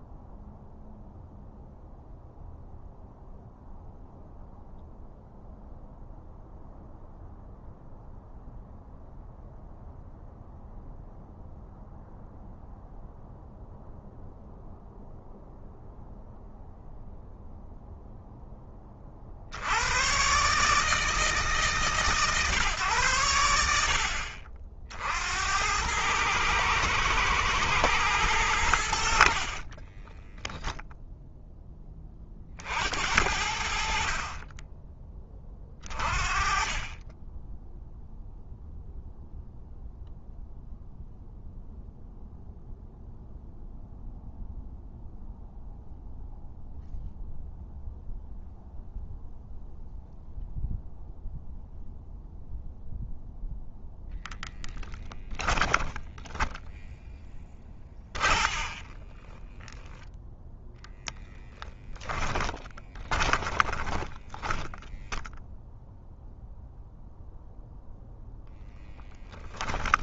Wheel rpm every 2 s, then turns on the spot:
0, 0, 0, 0, 0, 0, 0, 0, 0, 20, 160, 130, 60, 120, 70, 0, 60, 30, 20, 0, 0, 0, 0, 0, 0, 0, 0, 10, 10, 40, 10, 20, 10, 0, 10.
54-60 62-66